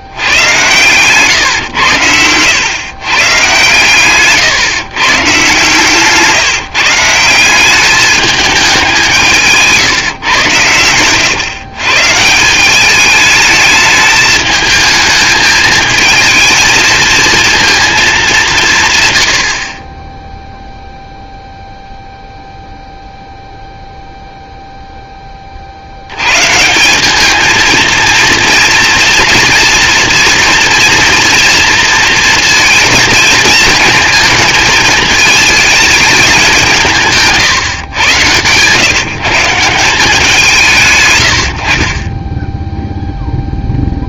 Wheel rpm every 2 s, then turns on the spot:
120, 130, 140, 160, 200, 110, 190, 220, 220, 160, 0, 0, 0, 180, 230, 230, 230, 220, 170, 130, 150, 0.
none